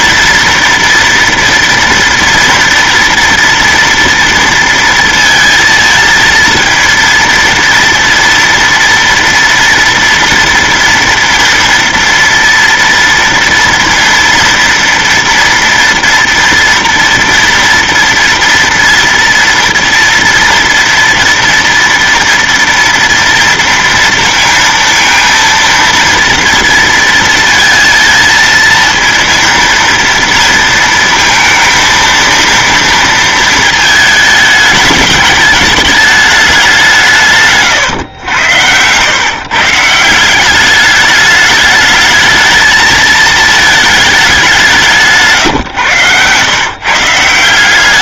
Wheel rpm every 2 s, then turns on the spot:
230, 230, 230, 230, 230, 230, 230, 230, 230, 230, 230, 230, 230, 230, 230, 230, 230, 220, 210, 100, 180, 220, 200, 120.
none